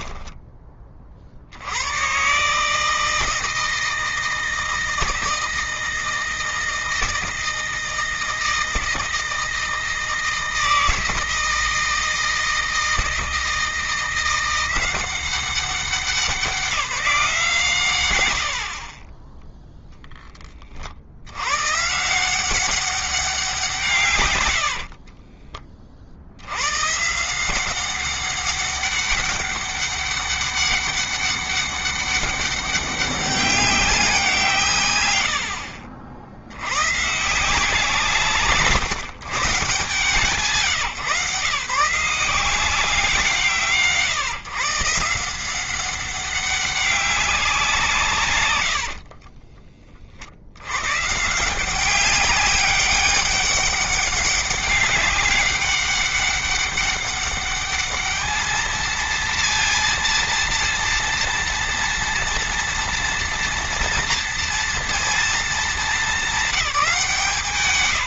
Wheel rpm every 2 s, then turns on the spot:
30, 160, 160, 160, 160, 160, 160, 180, 170, 40, 80, 190, 50, 130, 200, 200, 200, 130, 150, 140, 130, 170, 160, 190, 50, 130, 200, 190, 200, 230, 230, 240, 230, 180.
24-26 48-50